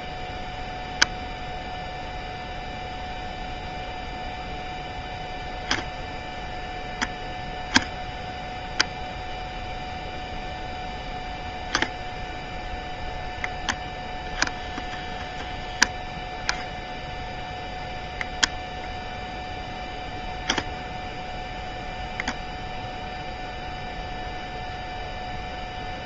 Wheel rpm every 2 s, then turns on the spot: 0, 0, 0, 0, 0, 0, 0, 0, 0, 0, 0, 0, 0.
none